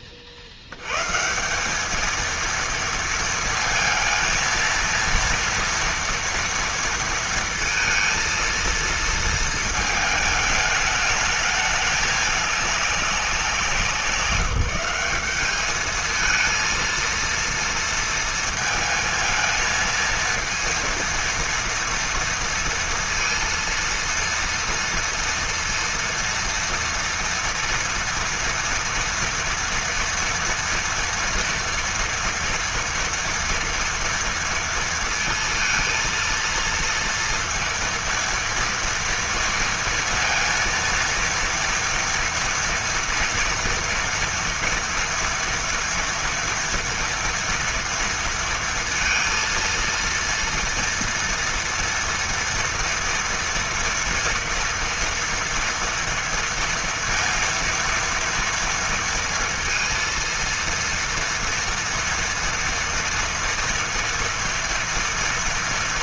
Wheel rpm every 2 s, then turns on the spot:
70, 230, 230, 230, 230, 210, 200, 180, 230, 230, 230, 230, 230, 240, 230, 230, 230, 230, 230, 230, 230, 230, 230, 240, 230, 230, 230, 230, 230, 230, 230, 230, 230.
none